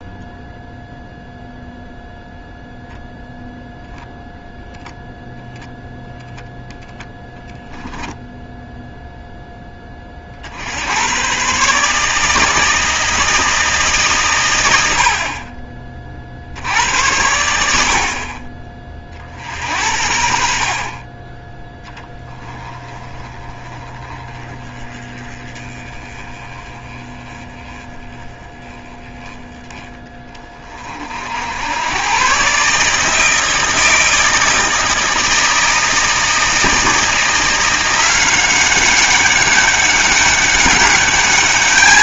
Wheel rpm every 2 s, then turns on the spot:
0, 0, 0, 0, 10, 60, 160, 110, 70, 30, 40, 20, 20, 20, 20, 30, 130, 160, 160, 190, 200.
none